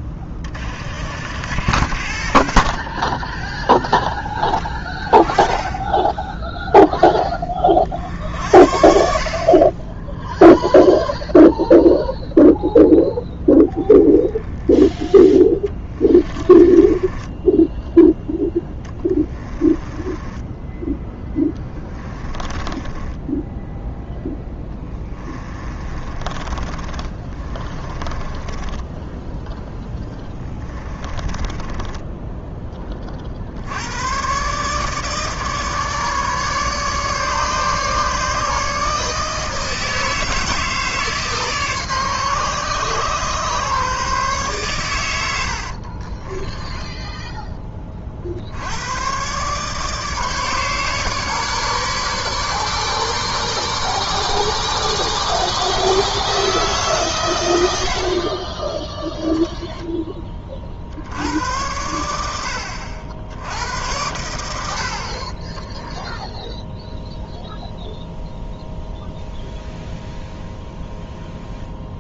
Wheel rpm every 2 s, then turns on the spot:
40, 40, 20, 0, 70, 0, 0, 10, 10, 10, 10, 20, 10, 20, 20, 20, 20, 150, 150, 150, 160, 130, 130, 10, 80, 150, 150, 160, 150, 10, 40, 70, 80, 0, 0, 0.
16-32